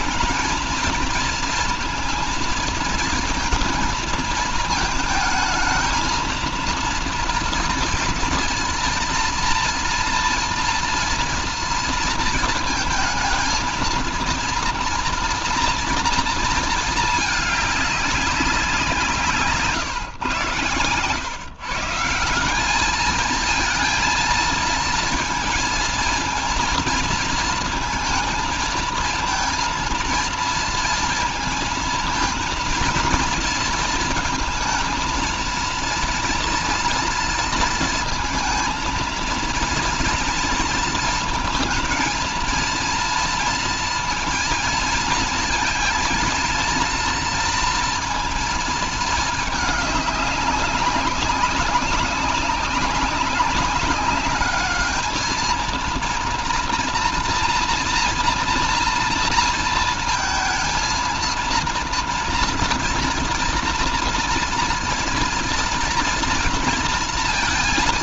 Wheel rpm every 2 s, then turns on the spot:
220, 230, 220, 230, 230, 230, 220, 230, 220, 180, 120, 190, 230, 230, 230, 230, 230, 220, 230, 230, 230, 230, 230, 230, 230, 200, 200, 210, 230, 230, 230, 230, 230, 230.
none